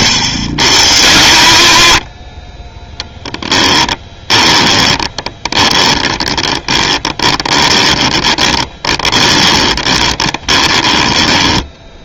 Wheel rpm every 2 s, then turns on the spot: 110, 30, 20, 20, 20, 20.
4-12